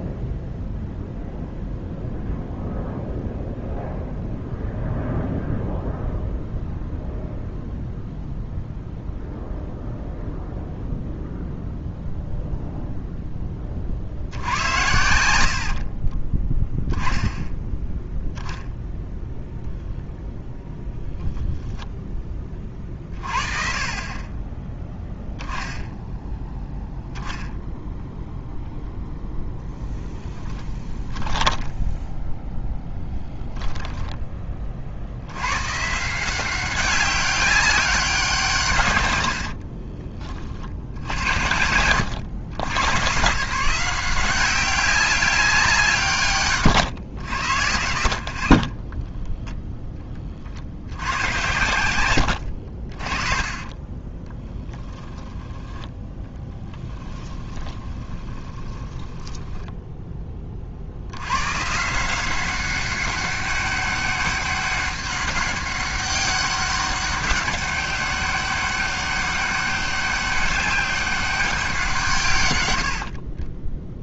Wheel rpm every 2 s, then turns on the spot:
0, 0, 0, 0, 0, 0, 0, 80, 10, 0, 0, 20, 20, 0, 0, 10, 10, 40, 190, 150, 50, 100, 190, 120, 60, 60, 60, 10, 10, 20, 40, 190, 200, 200, 200, 200, 100.
46-50 54-60 72-74